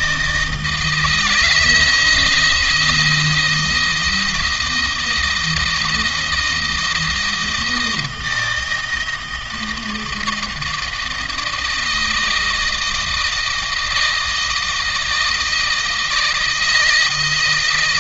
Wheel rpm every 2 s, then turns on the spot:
160, 160, 170, 170, 160, 160, 160, 160, 160.
none